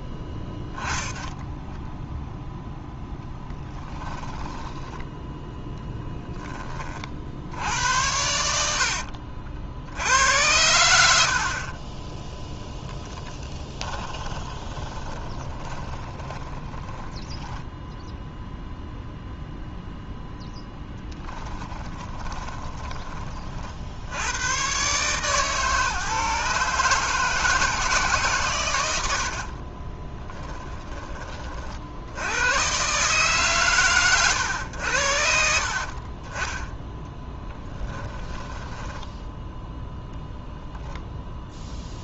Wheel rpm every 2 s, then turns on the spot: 10, 0, 10, 30, 70, 80, 10, 10, 10, 0, 10, 20, 130, 150, 110, 10, 130, 90, 10, 10, 10.
8-10 14-18 20-22 36-38 40-42